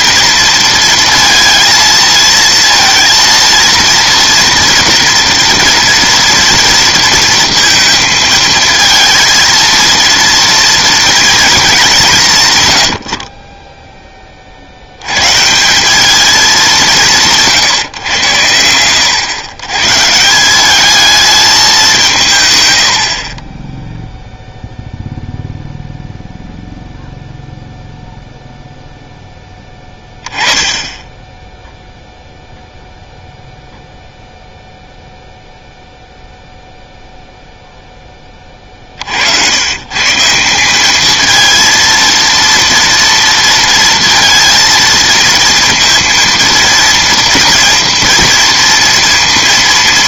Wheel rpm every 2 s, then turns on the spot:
230, 230, 240, 230, 220, 230, 100, 70, 200, 90, 190, 110, 0, 0, 0, 10, 0, 0, 0, 40, 180, 230, 230, 230, 230.
none